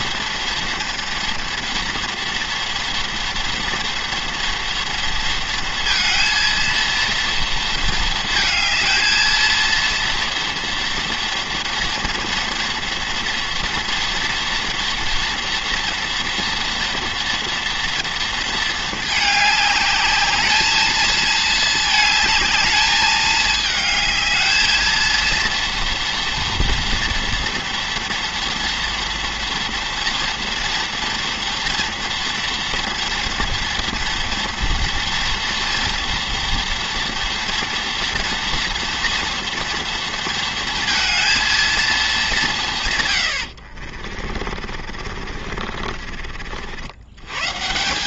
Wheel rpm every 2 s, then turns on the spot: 240, 230, 230, 230, 220, 230, 230, 230, 230, 220, 220, 210, 220, 240, 230, 230, 230, 230, 230, 230, 230, 160, 50, 70.
44-46